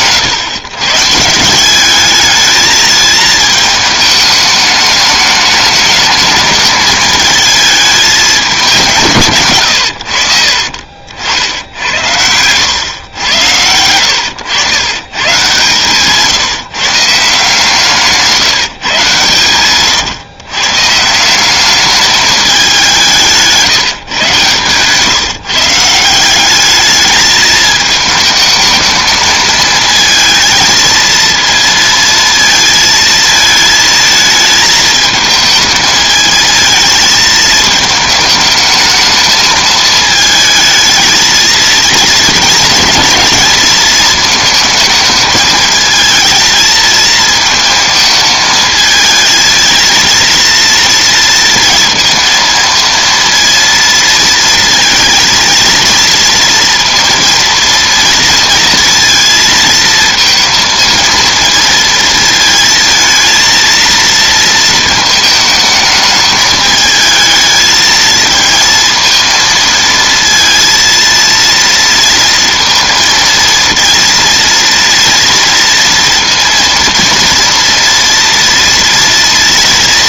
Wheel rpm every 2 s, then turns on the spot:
120, 220, 210, 220, 200, 60, 100, 100, 150, 150, 130, 200, 140, 210, 220, 230, 230, 220, 220, 220, 220, 220, 220, 220, 220, 230, 230, 230, 230, 230, 230, 230, 220, 210, 230, 230, 230, 230, 230, 230.
none